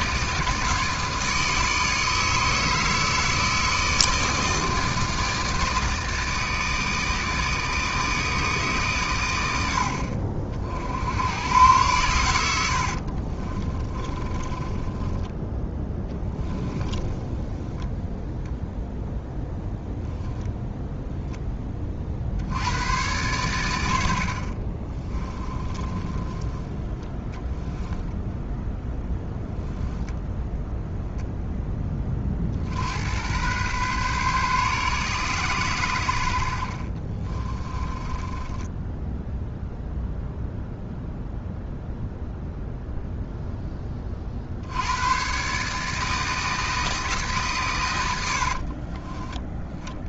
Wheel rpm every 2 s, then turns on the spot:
160, 160, 160, 160, 150, 50, 80, 20, 10, 0, 0, 70, 40, 10, 0, 10, 50, 140, 70, 20, 0, 0, 50, 160, 70.
12-18 26-28 38-40 48-50